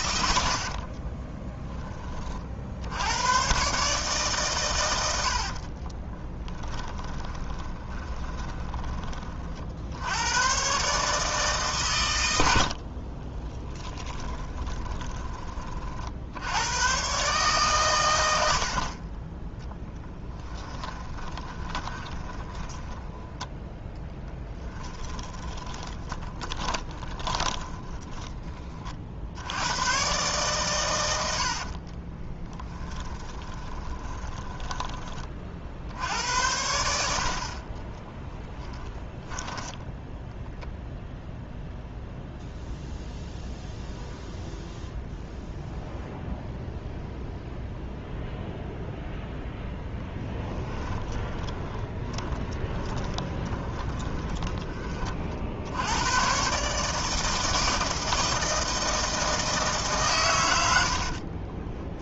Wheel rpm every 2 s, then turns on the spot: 40, 60, 110, 20, 30, 120, 70, 20, 100, 50, 20, 10, 10, 20, 30, 110, 10, 20, 80, 10, 0, 0, 0, 0, 0, 10, 10, 30, 140, 160, 80.
0-2 6-8 12-16 20-28 32-36 38-40 50-54 60-62